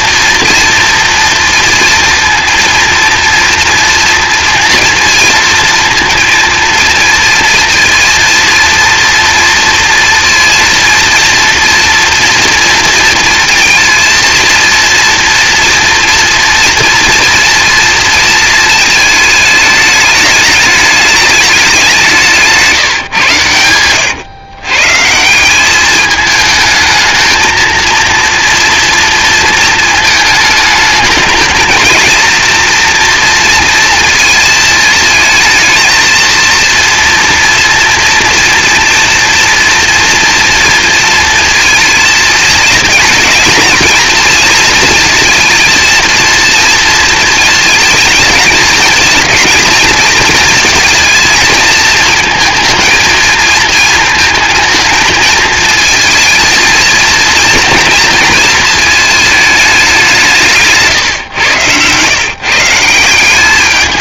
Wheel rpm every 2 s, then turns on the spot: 230, 230, 230, 230, 230, 230, 240, 230, 230, 220, 210, 140, 140, 220, 230, 210, 230, 220, 230, 230, 230, 220, 230, 230, 230, 220, 230, 220, 230, 220, 130, 170.
22-24